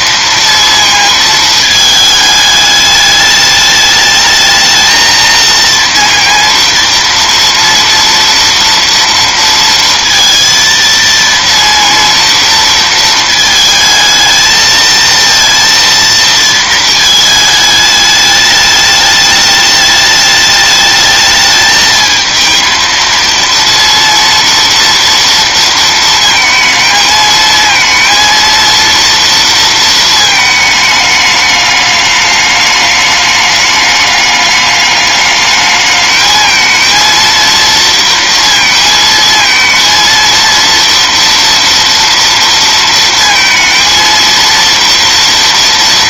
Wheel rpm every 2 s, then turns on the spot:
230, 210, 220, 230, 230, 230, 230, 220, 220, 210, 210, 220, 230, 220, 230, 220, 210, 210, 230, 230, 230, 230, 230.
none